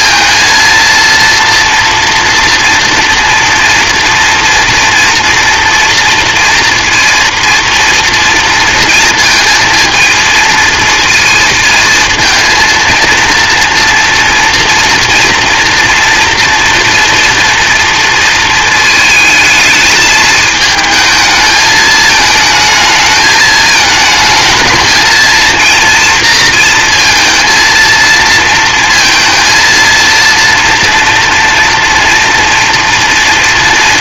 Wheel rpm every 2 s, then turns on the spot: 230, 240, 230, 230, 230, 230, 230, 230, 230, 220, 220, 220, 230, 230, 230, 230, 230.
none